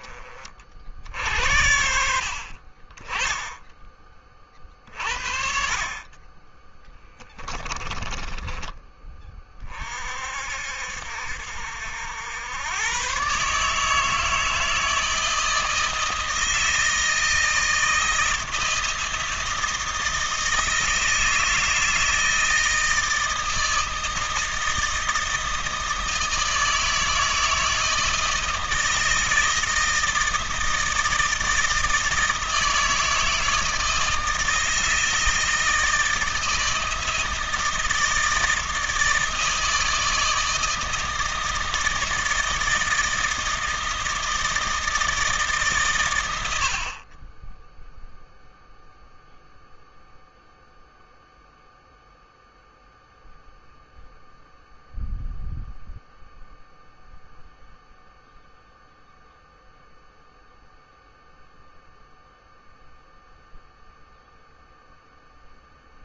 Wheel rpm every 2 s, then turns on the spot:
40, 50, 30, 20, 20, 60, 100, 160, 160, 160, 160, 160, 160, 160, 160, 160, 160, 160, 160, 160, 160, 160, 160, 70, 0, 0, 0, 0, 0, 0, 0, 0, 0.
none